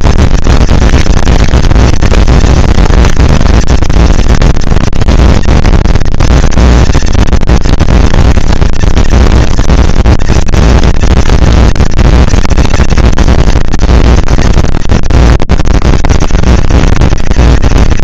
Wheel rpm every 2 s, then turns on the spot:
230, 230, 230, 230, 230, 230, 230, 230, 200.
none